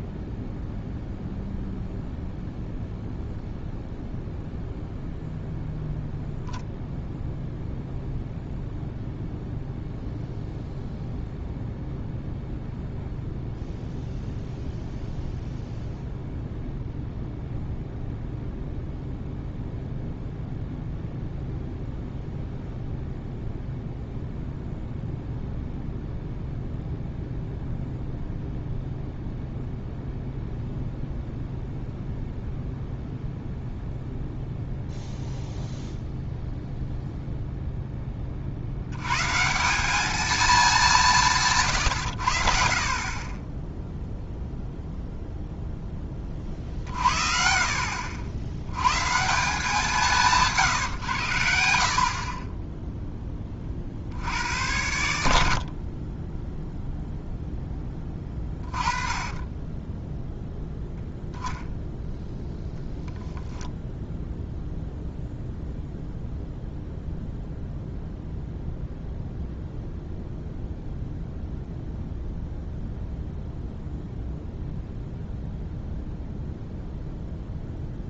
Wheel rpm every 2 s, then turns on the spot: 0, 0, 0, 0, 0, 0, 0, 0, 0, 0, 0, 0, 0, 0, 0, 0, 0, 0, 0, 60, 200, 60, 0, 40, 110, 140, 10, 80, 0, 20, 0, 0, 0, 0, 0, 0, 0, 0, 0.
none